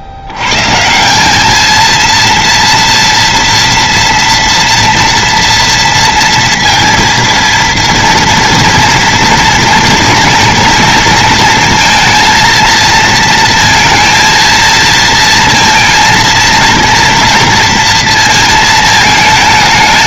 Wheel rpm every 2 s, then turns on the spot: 140, 230, 230, 230, 230, 230, 230, 230, 230, 220.
none